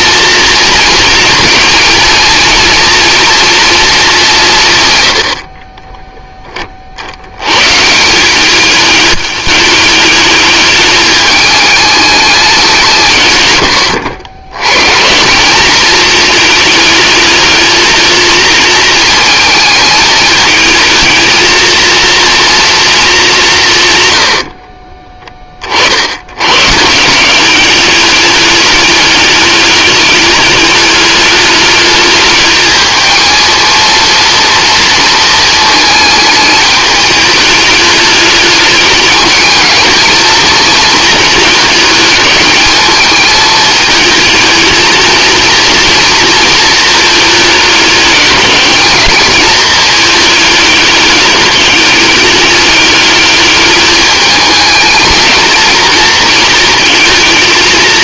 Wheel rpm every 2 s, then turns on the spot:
230, 240, 110, 60, 210, 210, 160, 140, 220, 220, 220, 220, 40, 170, 210, 210, 220, 230, 210, 210, 220, 220, 230, 220, 210, 210, 210, 220, 220.
24-26